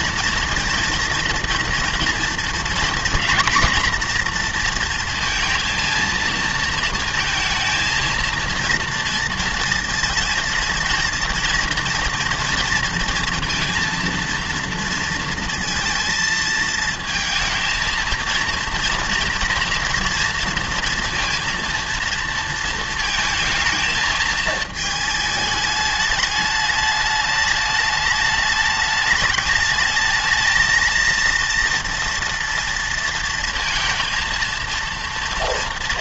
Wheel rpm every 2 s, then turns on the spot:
230, 230, 230, 230, 230, 230, 230, 230, 220, 230, 230, 230, 220, 210, 210, 230, 230, 230.
none